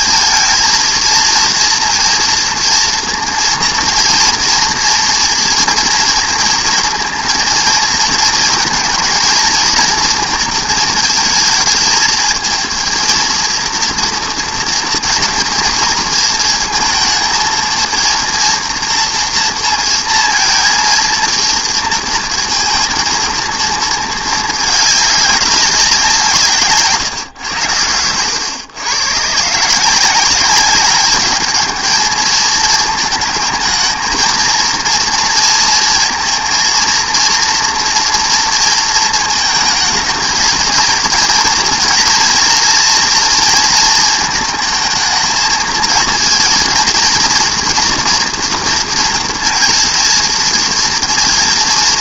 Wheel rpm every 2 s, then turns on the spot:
230, 240, 230, 230, 230, 230, 230, 230, 230, 230, 230, 230, 210, 150, 110, 200, 220, 220, 230, 230, 230, 230, 220, 230, 240, 230.
none